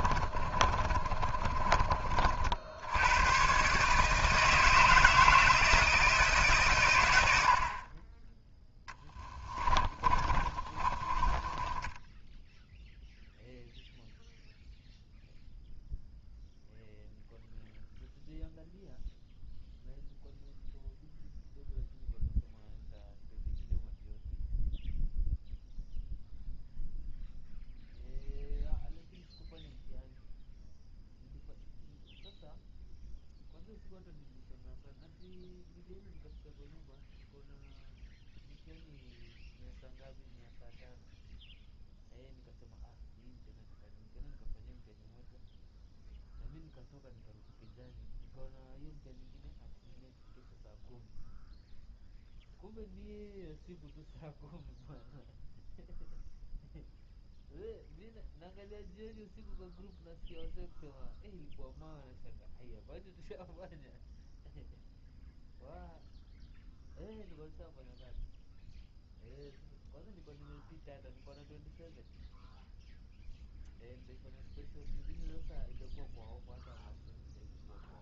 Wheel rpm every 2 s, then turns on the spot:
30, 90, 160, 130, 10, 30, 0, 0, 0, 0, 0, 0, 0, 0, 0, 0, 0, 0, 0, 0, 0, 0, 0, 0, 0, 0, 0, 0, 0, 0, 0, 0, 0, 0, 0, 0, 0, 0, 0.
0-2 8-12